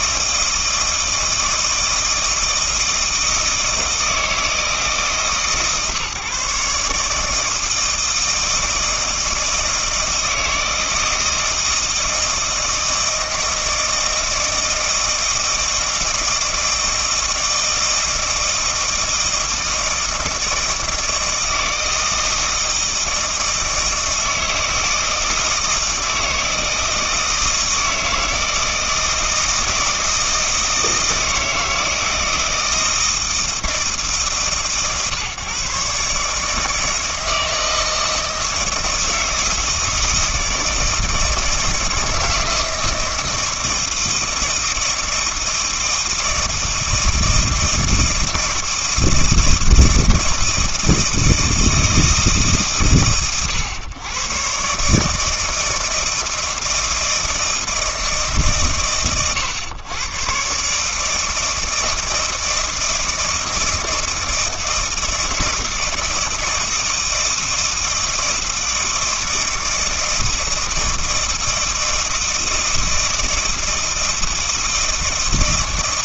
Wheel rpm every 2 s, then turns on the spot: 160, 160, 160, 150, 160, 160, 160, 160, 160, 160, 160, 160, 160, 160, 160, 160, 160, 140, 160, 160, 160, 160, 160, 160, 160, 160, 120, 130, 160, 120, 140, 160, 160, 160, 160, 160, 160, 160.
none